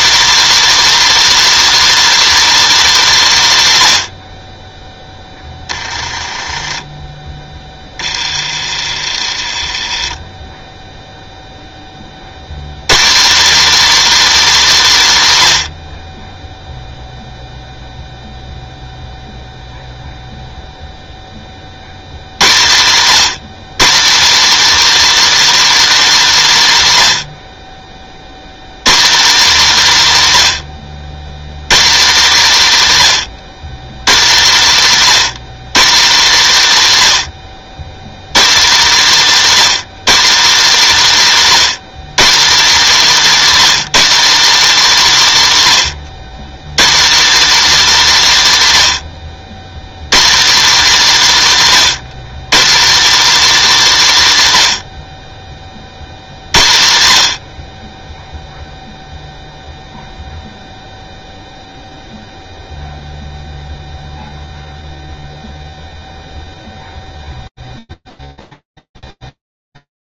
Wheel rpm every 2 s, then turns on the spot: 320, 300, 30, 30, 50, 10, 120, 270, 0, 0, 0, 120, 290, 200, 160, 100, 190, 170, 170, 200, 220, 240, 270, 140, 170, 240, 210, 110, 90, 0, 0, 0, 0, 0, 0.
6-12